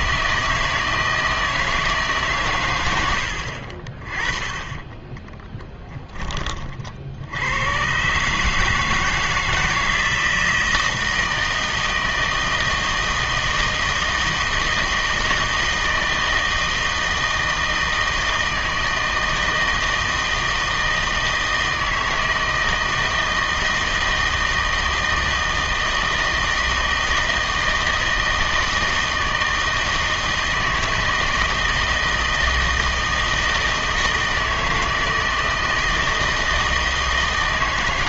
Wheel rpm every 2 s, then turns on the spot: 160, 120, 20, 30, 150, 160, 160, 160, 160, 160, 160, 160, 160, 160, 160, 160, 160, 160, 160.
none